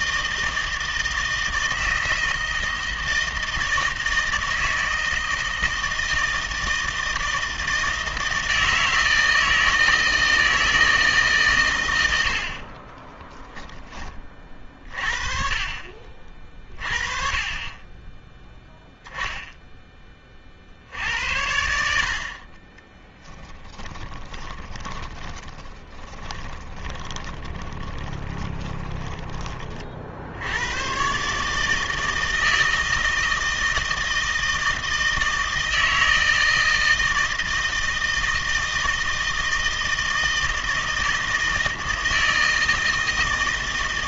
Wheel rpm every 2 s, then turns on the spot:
160, 160, 160, 160, 160, 160, 20, 30, 30, 0, 70, 20, 10, 20, 20, 120, 160, 160, 160, 160, 160, 160.
12-14 22-30